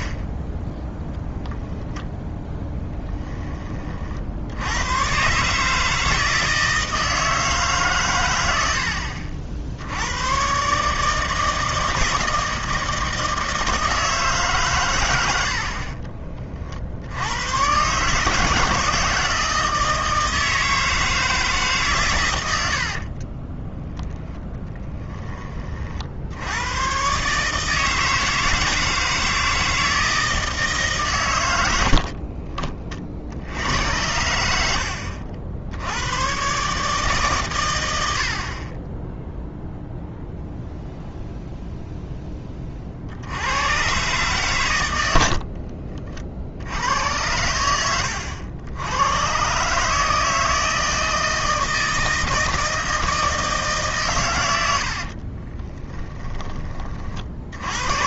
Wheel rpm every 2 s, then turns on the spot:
10, 10, 90, 160, 80, 140, 160, 130, 50, 160, 160, 70, 10, 100, 160, 150, 30, 80, 140, 40, 0, 40, 110, 80, 90, 160, 160, 80, 40.
22-24 54-56